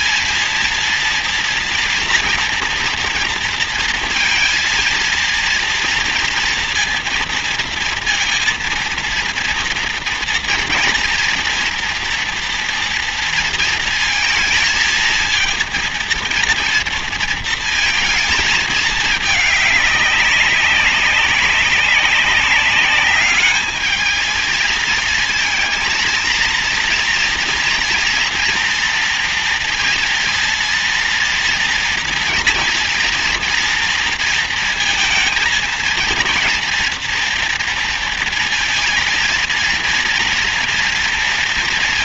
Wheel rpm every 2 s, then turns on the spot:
230, 230, 230, 230, 230, 230, 230, 230, 230, 210, 190, 200, 230, 230, 230, 230, 230, 220, 230, 230, 240.
none